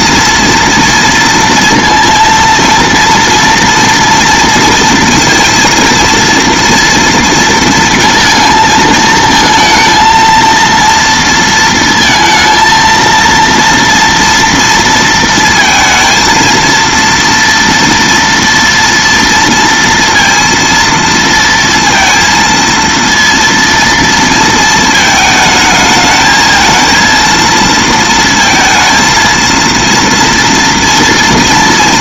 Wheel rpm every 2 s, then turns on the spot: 230, 230, 230, 230, 230, 230, 230, 230, 230, 230, 230, 230, 230, 220, 230, 230.
none